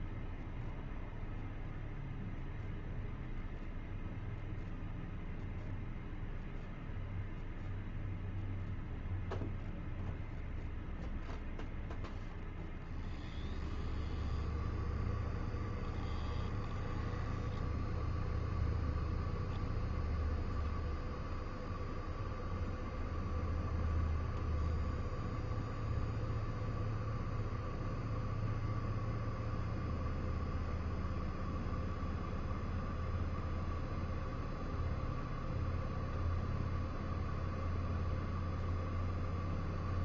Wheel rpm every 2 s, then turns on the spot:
0, 0, 0, 0, 0, 0, 0, 0, 0, 0, 0, 0, 0, 0, 0, 0, 0, 0, 0, 0.
none